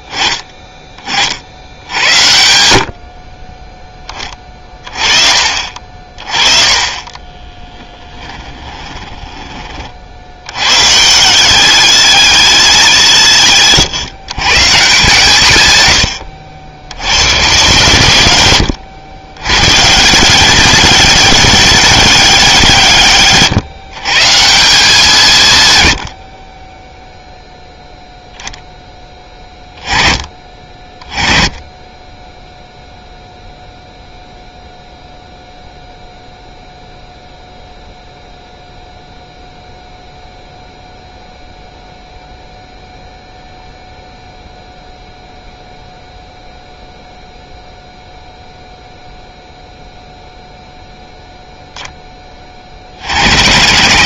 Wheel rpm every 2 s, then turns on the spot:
30, 70, 30, 30, 20, 130, 110, 150, 90, 90, 190, 150, 180, 10, 10, 30, 0, 0, 0, 0, 0, 0, 0, 0, 0, 0, 60.
6-10